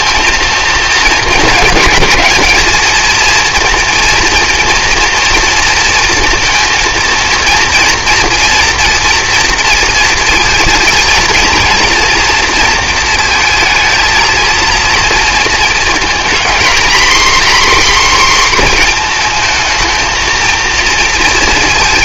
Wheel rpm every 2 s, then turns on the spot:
230, 220, 230, 230, 230, 230, 230, 220, 240, 250, 230.
none